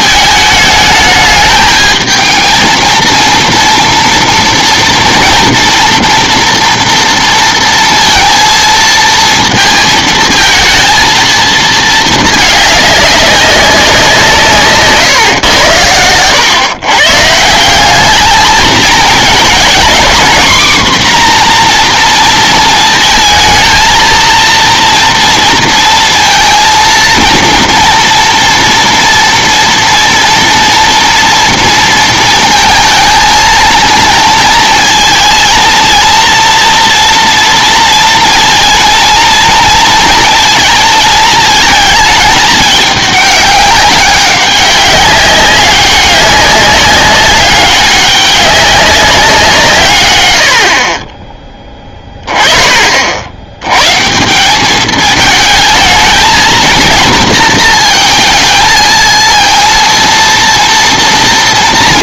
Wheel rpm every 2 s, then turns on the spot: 220, 230, 230, 230, 230, 220, 210, 150, 120, 220, 250, 230, 230, 230, 240, 230, 220, 230, 230, 230, 220, 210, 200, 200, 200, 70, 50, 190, 230, 220, 230.
none